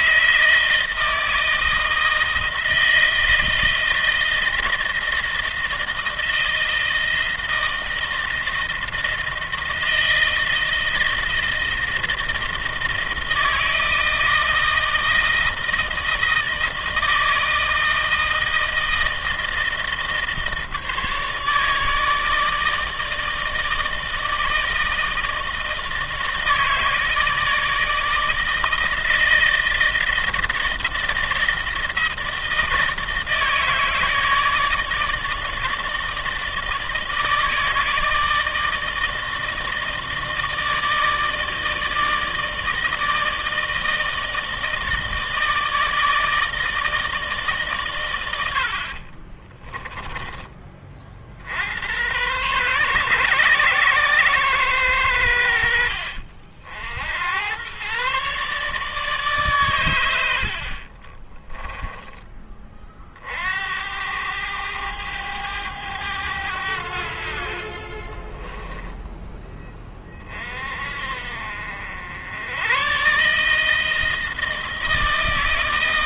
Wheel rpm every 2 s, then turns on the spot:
160, 160, 160, 160, 160, 160, 160, 160, 160, 160, 160, 160, 160, 160, 160, 160, 160, 150, 160, 160, 160, 160, 160, 160, 80, 30, 120, 110, 60, 140, 60, 30, 100, 80, 20, 40, 100, 160.
48-50 68-70